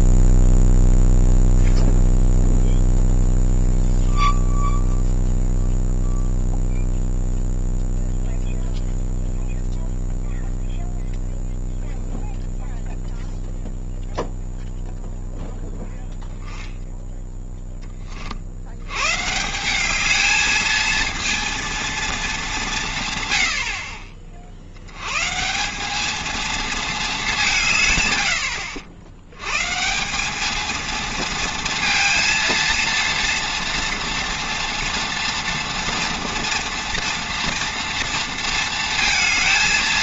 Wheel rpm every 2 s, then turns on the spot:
0, 0, 0, 0, 0, 0, 0, 0, 0, 80, 220, 170, 70, 230, 80, 220, 230, 230, 240, 230.
none